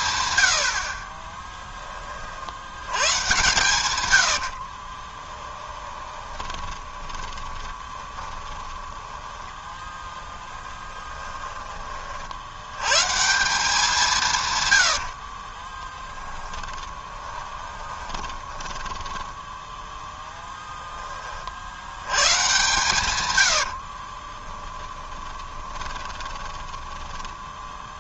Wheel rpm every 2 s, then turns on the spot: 70, 90, 50, 20, 10, 20, 110, 120, 20, 10, 10, 130, 10, 20.
4-8 10-12 14-20 24-28